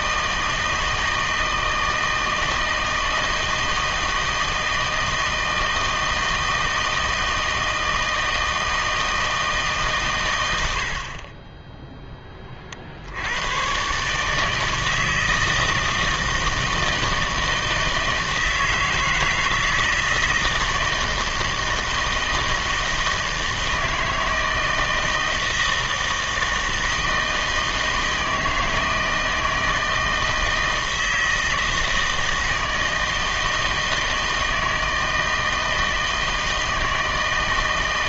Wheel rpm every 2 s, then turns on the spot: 160, 160, 160, 160, 160, 70, 50, 160, 160, 160, 160, 160, 160, 160, 160, 160, 160, 160, 160.
none